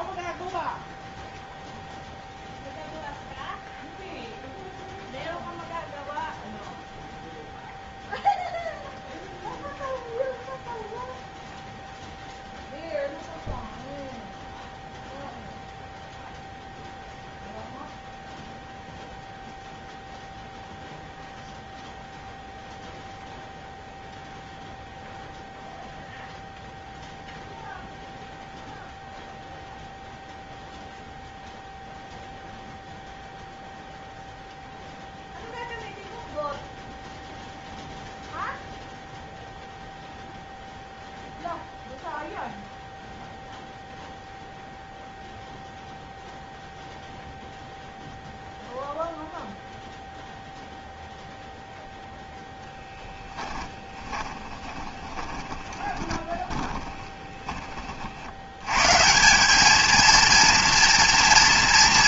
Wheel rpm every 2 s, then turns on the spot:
0, 0, 0, 0, 0, 0, 0, 0, 0, 0, 0, 0, 0, 0, 0, 0, 0, 0, 0, 0, 0, 0, 0, 0, 0, 0, 10, 20, 30, 150, 230.
52-58